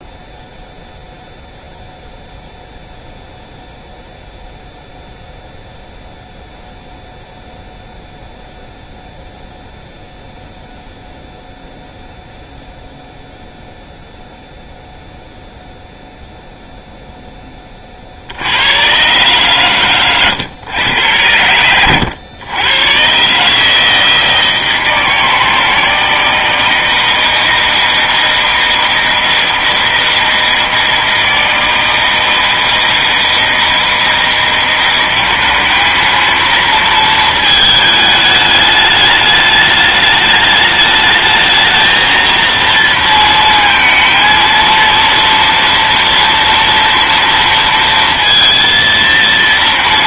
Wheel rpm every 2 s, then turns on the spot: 0, 0, 0, 0, 0, 0, 0, 0, 0, 90, 120, 100, 160, 160, 160, 160, 160, 170, 220, 210, 210, 230, 230, 230, 230.
none